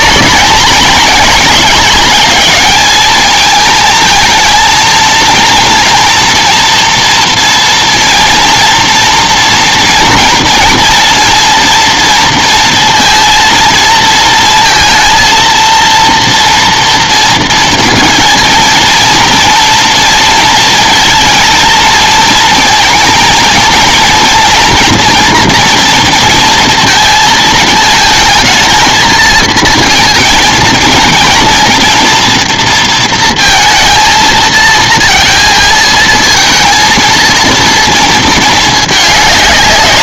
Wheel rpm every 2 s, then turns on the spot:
220, 220, 220, 230, 230, 230, 230, 230, 230, 230, 230, 230, 230, 230, 220, 230, 230, 230, 230, 220.
none